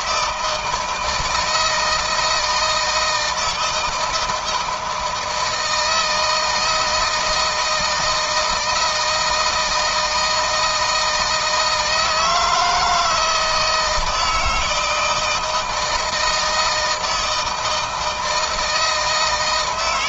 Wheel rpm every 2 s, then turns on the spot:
160, 160, 170, 160, 160, 160, 160, 160, 160, 160.
none